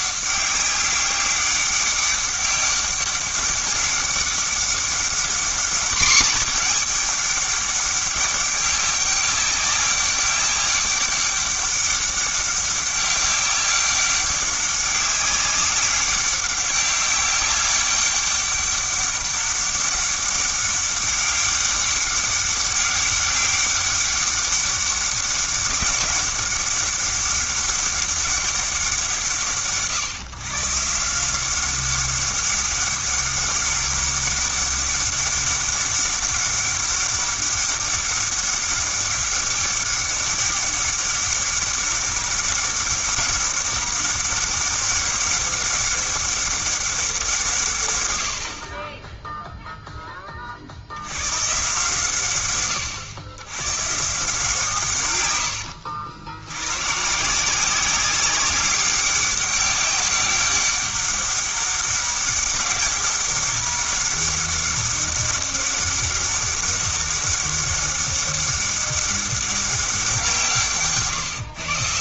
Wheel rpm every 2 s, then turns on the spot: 200, 200, 200, 220, 200, 200, 200, 190, 200, 200, 200, 200, 200, 200, 190, 150, 200, 200, 200, 200, 200, 200, 200, 200, 40, 50, 130, 150, 100, 200, 200, 190, 200, 200, 200, 150.
none